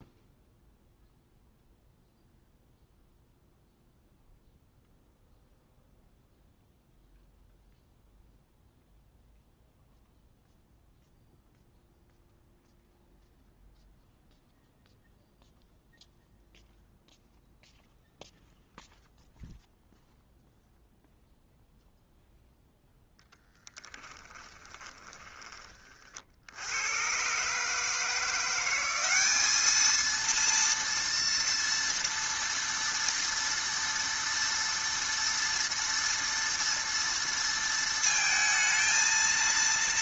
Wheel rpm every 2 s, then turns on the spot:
0, 0, 0, 0, 0, 0, 0, 0, 0, 0, 0, 0, 20, 80, 180, 230, 230, 230, 230, 230.
24-26